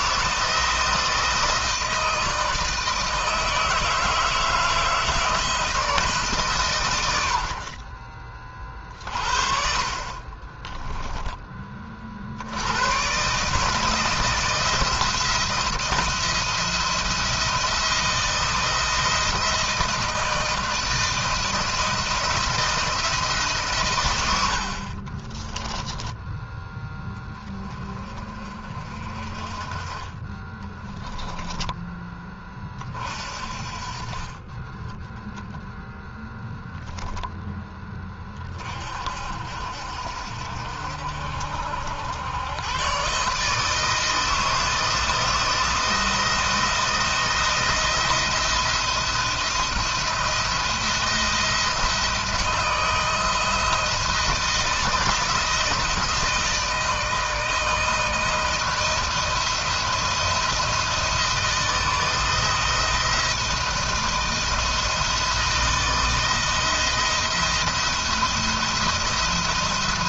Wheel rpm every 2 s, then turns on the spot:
160, 160, 160, 130, 40, 20, 90, 170, 170, 170, 170, 160, 80, 10, 30, 20, 30, 30, 10, 40, 60, 110, 160, 170, 170, 170, 160, 160, 160, 160, 170, 160, 170, 170, 170.
10-12 24-26